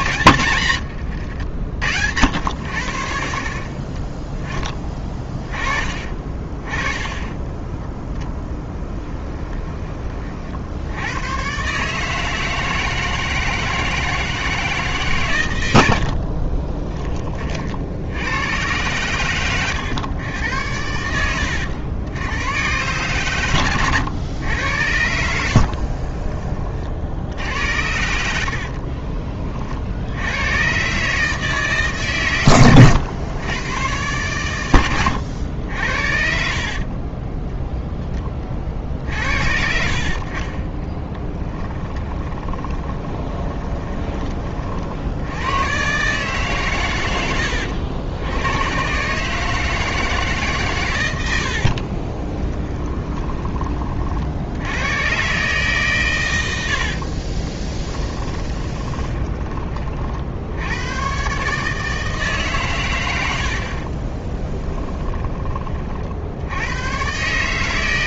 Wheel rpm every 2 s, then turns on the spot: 100, 80, 20, 20, 10, 70, 160, 140, 20, 110, 90, 130, 100, 40, 50, 130, 110, 100, 40, 60, 20, 20, 60, 120, 120, 120, 20, 110, 80, 20, 100, 110, 20, 100.
0-2 6-10 20-22 28-30 34-38 42-44 52-54 56-60 64-66